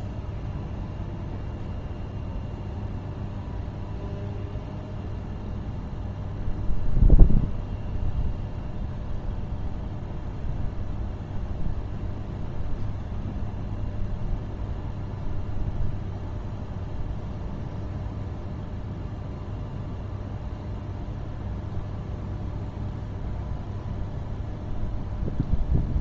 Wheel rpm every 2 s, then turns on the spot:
0, 0, 0, 0, 0, 0, 0, 0, 0, 0, 0, 0, 0.
none